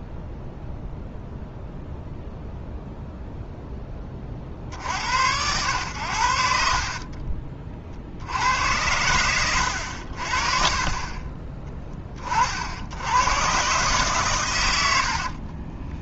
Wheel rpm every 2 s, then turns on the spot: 0, 0, 70, 50, 90, 40, 70, 90.
6-8